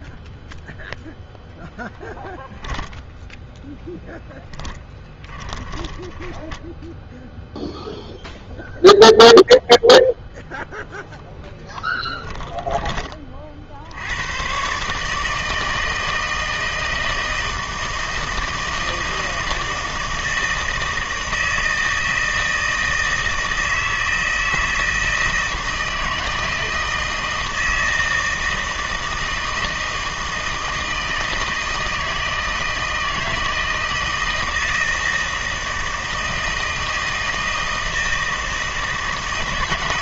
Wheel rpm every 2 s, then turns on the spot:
0, 10, 10, 10, 0, 0, 20, 140, 160, 160, 160, 160, 160, 160, 160, 160, 160, 160, 160, 160.
4-8